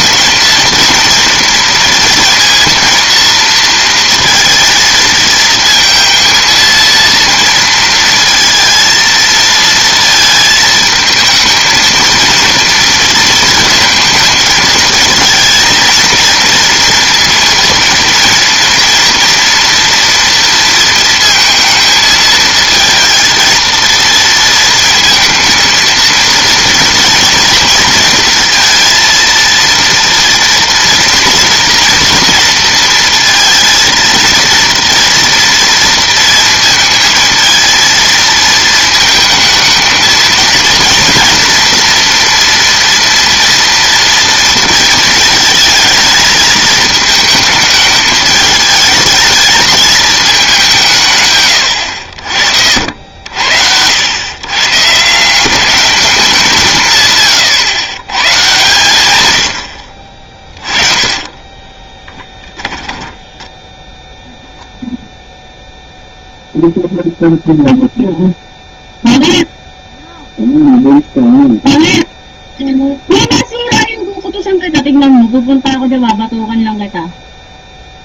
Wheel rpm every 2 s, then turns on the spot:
230, 230, 230, 230, 230, 220, 230, 220, 230, 230, 230, 230, 230, 230, 230, 230, 230, 230, 220, 220, 230, 230, 230, 220, 220, 160, 80, 150, 160, 120, 20, 10, 0, 0, 0, 0, 0, 0, 0.
60-64